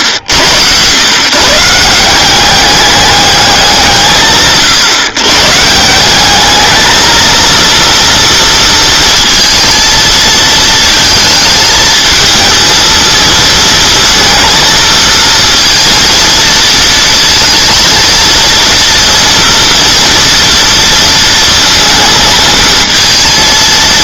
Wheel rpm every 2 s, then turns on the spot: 110, 200, 140, 220, 230, 220, 220, 220, 220, 230, 230, 230.
none